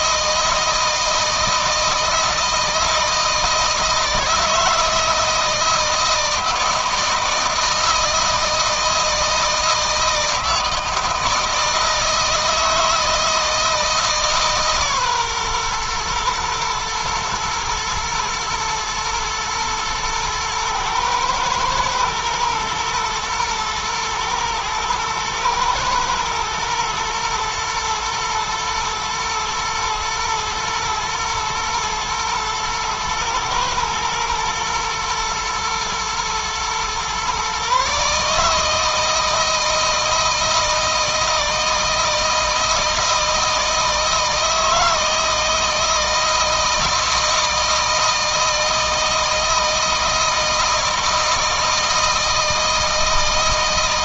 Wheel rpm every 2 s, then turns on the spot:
160, 160, 160, 160, 160, 160, 160, 140, 120, 120, 110, 120, 110, 110, 110, 120, 120, 120, 120, 150, 160, 160, 160, 160, 160, 160, 160.
none